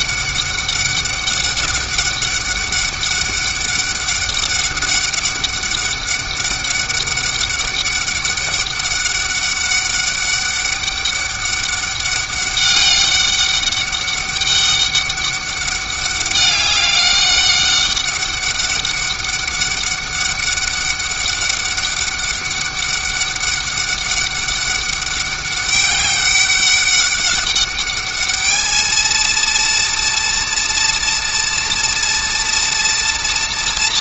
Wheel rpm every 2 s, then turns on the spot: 200, 200, 200, 200, 200, 200, 200, 200, 200, 200, 200, 200, 200, 200, 220, 230, 230.
none